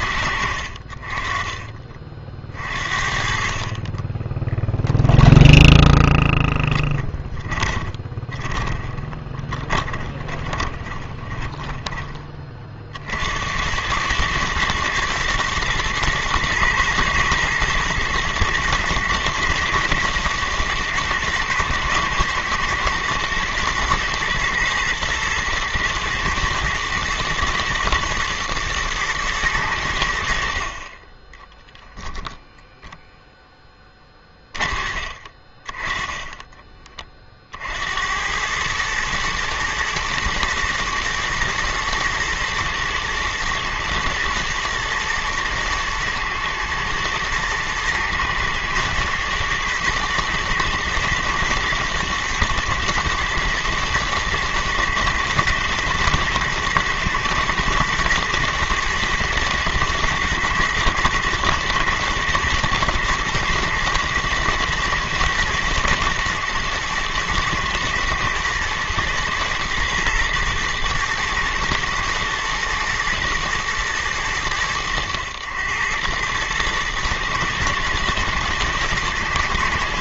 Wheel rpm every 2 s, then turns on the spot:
70, 40, 20, 20, 20, 20, 40, 120, 110, 110, 120, 120, 120, 120, 110, 60, 0, 30, 20, 100, 120, 110, 110, 120, 110, 120, 120, 110, 110, 120, 110, 120, 110, 110, 110, 120, 120, 110, 110, 110.
4-12